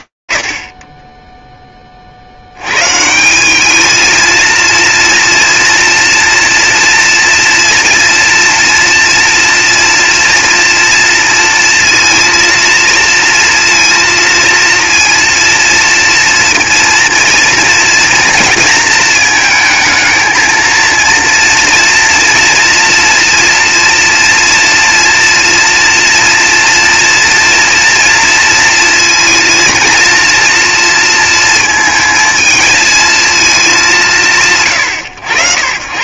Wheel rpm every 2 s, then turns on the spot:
20, 80, 230, 230, 230, 230, 230, 230, 230, 230, 220, 230, 240, 230, 230, 230, 230, 140.
none